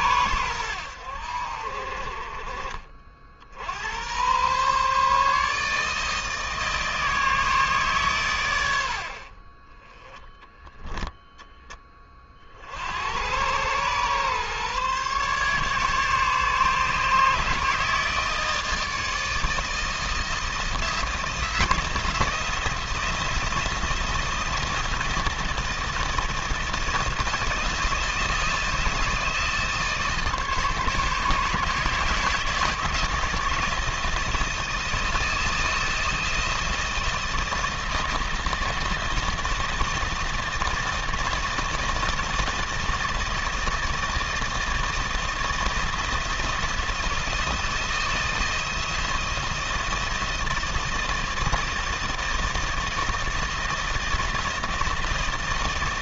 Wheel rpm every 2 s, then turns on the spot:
80, 50, 150, 160, 40, 10, 100, 140, 150, 160, 170, 170, 160, 160, 160, 150, 160, 160, 160, 160, 160, 160, 160, 160, 160, 160, 160, 160.
none